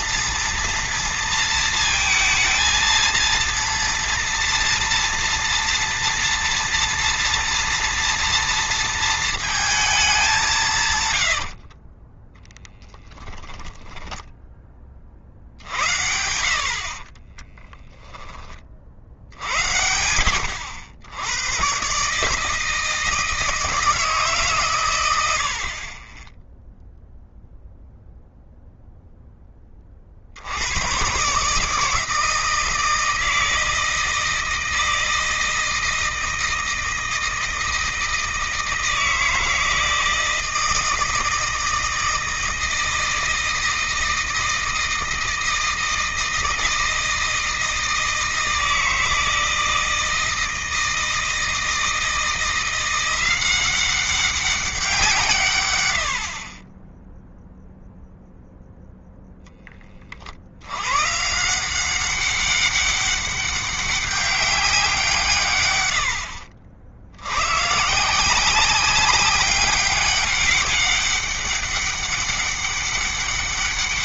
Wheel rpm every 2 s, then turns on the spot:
230, 230, 230, 230, 230, 130, 10, 30, 40, 50, 80, 160, 120, 0, 0, 110, 160, 160, 160, 160, 160, 160, 160, 160, 160, 160, 180, 170, 10, 0, 120, 200, 170, 80, 190, 200, 200.
10-14 16-18